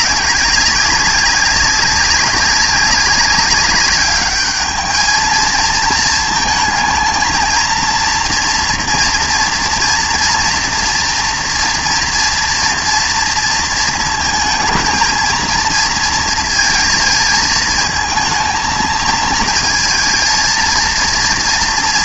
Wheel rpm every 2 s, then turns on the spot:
190, 200, 210, 220, 230, 230, 230, 230, 230, 230, 230.
none